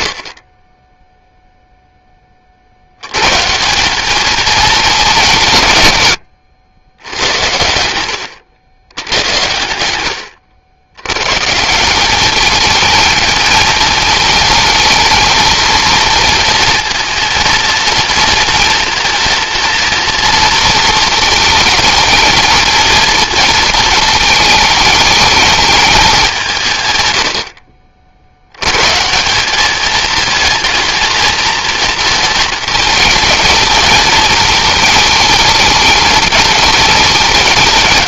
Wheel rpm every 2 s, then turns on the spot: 20, 50, 210, 90, 100, 100, 210, 220, 230, 230, 230, 220, 220, 170, 100, 230, 220, 220, 210.
none